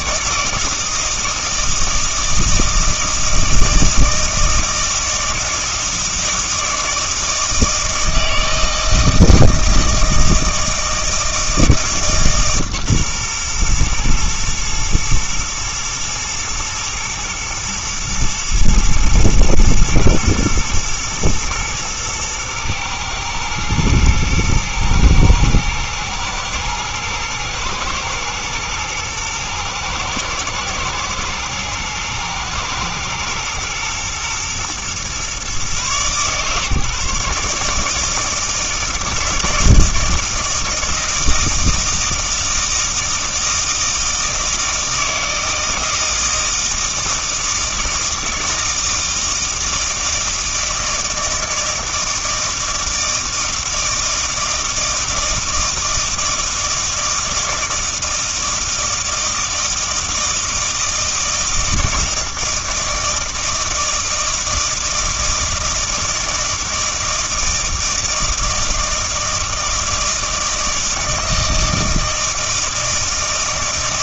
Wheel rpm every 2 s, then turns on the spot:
160, 160, 160, 160, 160, 160, 140, 110, 120, 110, 120, 120, 110, 110, 110, 110, 110, 120, 140, 160, 160, 160, 160, 160, 160, 160, 160, 160, 160, 160, 160, 160, 160, 160, 160, 160, 160.
none